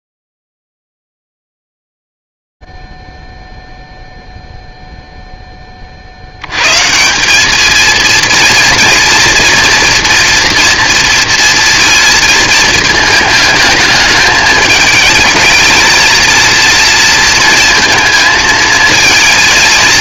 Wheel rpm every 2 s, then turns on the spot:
0, 0, 0, 30, 220, 240, 230, 210, 220, 230.
none